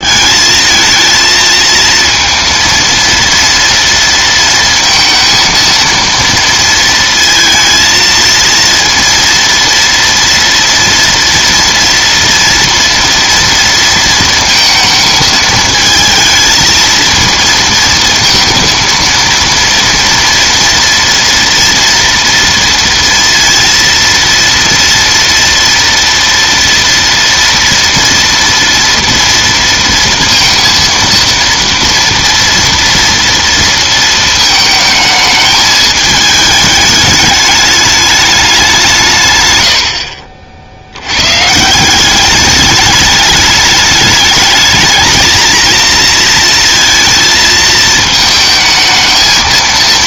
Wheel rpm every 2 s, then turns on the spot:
220, 230, 230, 230, 230, 230, 230, 230, 220, 230, 230, 230, 230, 230, 230, 230, 230, 220, 210, 190, 60, 210, 220, 230, 220.
none